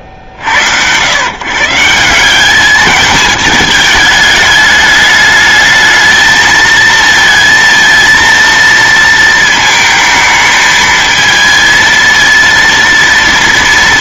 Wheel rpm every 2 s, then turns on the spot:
60, 210, 210, 220, 230, 220, 230.
none